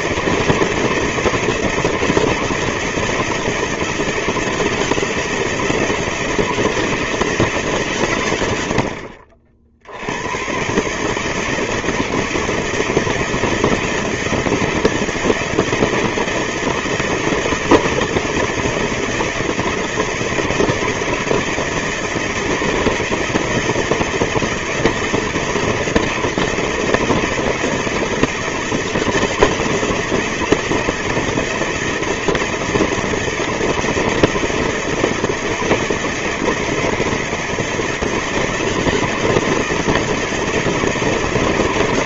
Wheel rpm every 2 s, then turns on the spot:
160, 160, 160, 160, 130, 90, 160, 160, 160, 160, 160, 160, 160, 160, 160, 170, 160, 160, 160, 160, 160.
none